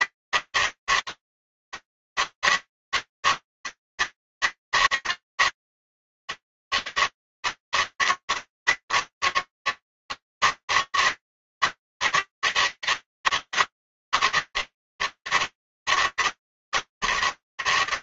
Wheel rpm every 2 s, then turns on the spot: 160, 160, 160, 160, 160, 160, 160, 150, 150.
none